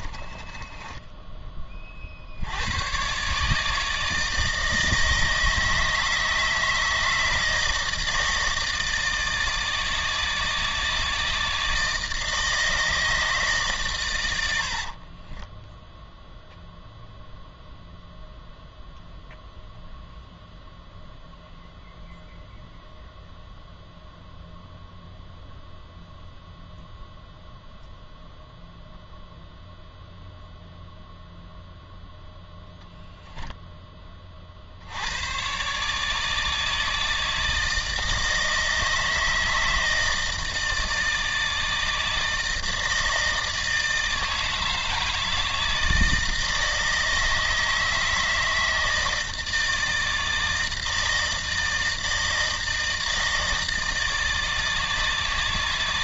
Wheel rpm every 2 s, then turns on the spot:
20, 90, 160, 160, 160, 160, 160, 60, 0, 0, 0, 0, 0, 0, 0, 0, 0, 60, 160, 160, 160, 160, 160, 160, 160, 160, 160, 160.
0-2 14-16